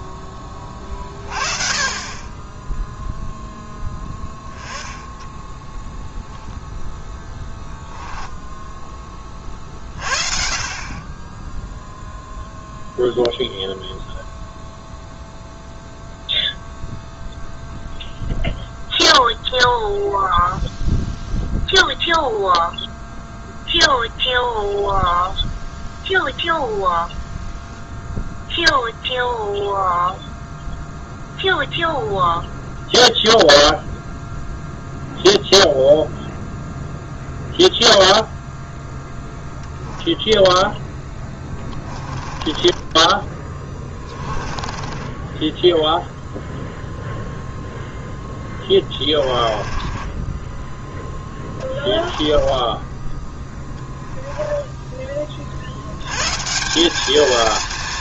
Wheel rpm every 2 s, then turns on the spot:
20, 10, 10, 0, 10, 40, 0, 0, 0, 0, 0, 0, 0, 0, 0, 0, 0, 0, 0, 0, 0, 30, 20, 0, 10, 10, 10, 10, 170.
42-46 48-50 52-56